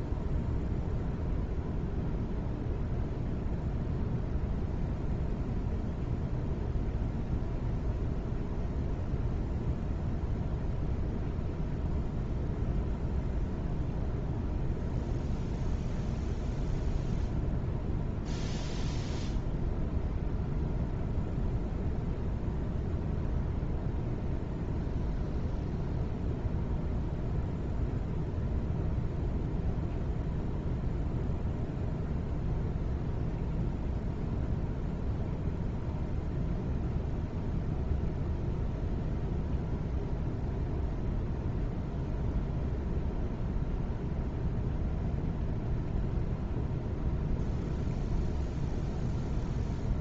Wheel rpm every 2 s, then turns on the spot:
0, 0, 0, 0, 0, 0, 0, 0, 0, 0, 0, 0, 0, 0, 0, 0, 0, 0, 0, 0, 0, 0, 0, 0, 0.
none